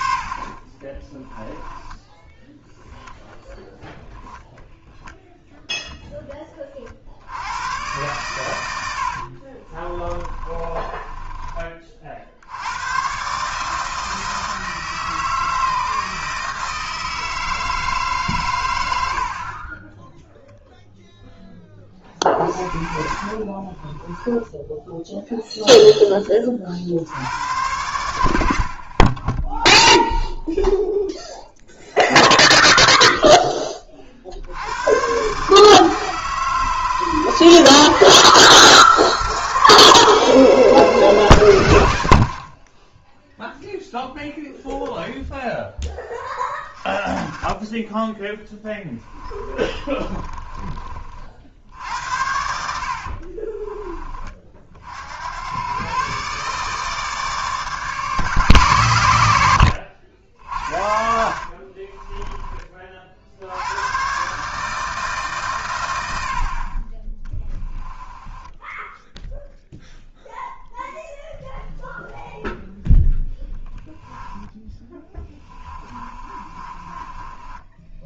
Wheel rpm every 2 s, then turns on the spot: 30, 10, 0, 30, 100, 20, 100, 160, 160, 110, 0, 40, 10, 40, 70, 0, 0, 90, 150, 160, 160, 40, 0, 40, 10, 30, 70, 40, 150, 110, 60, 30, 150, 40, 10, 0, 0, 10, 30.
0-2 8-12 22-24 48-50 52-54 60-62 66-70 74-78